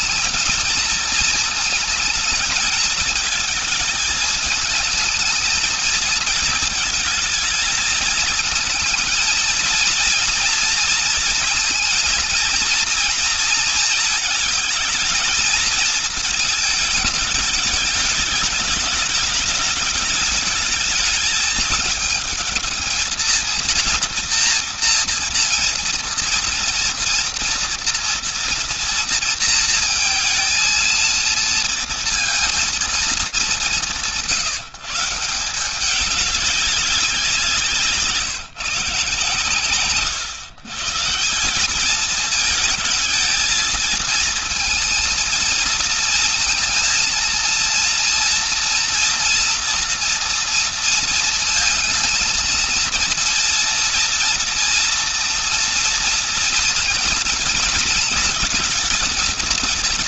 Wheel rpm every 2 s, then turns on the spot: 220, 220, 220, 230, 220, 230, 230, 220, 210, 210, 210, 220, 230, 230, 230, 230, 200, 170, 180, 140, 170, 220, 230, 230, 230, 230, 230, 240, 230, 220.
none